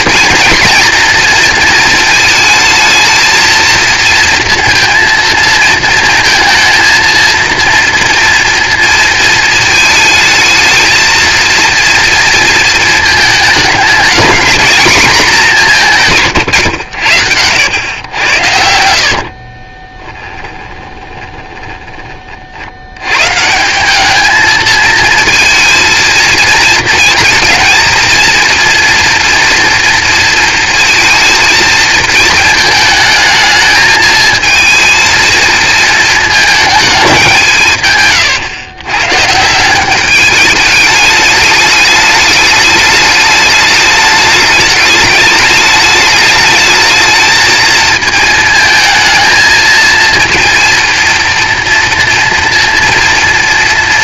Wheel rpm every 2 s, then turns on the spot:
230, 220, 230, 230, 230, 220, 230, 220, 100, 70, 20, 80, 220, 230, 240, 220, 220, 220, 210, 120, 210, 210, 210, 220, 220, 230, 240.
18-22